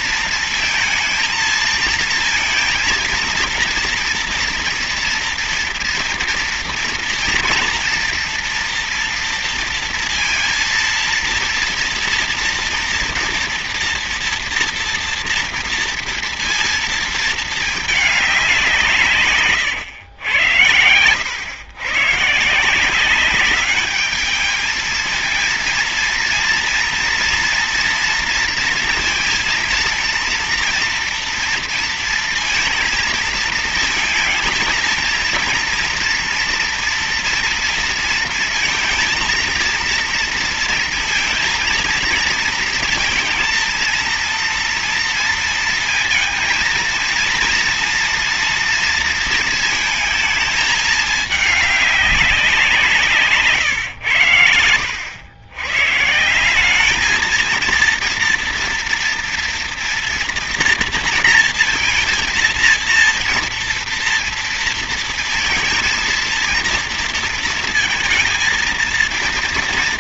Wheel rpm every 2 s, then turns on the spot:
230, 230, 230, 230, 240, 230, 230, 230, 230, 190, 110, 160, 210, 230, 230, 230, 230, 230, 230, 230, 230, 230, 230, 230, 230, 220, 180, 100, 180, 230, 230, 230, 230, 230, 230.
none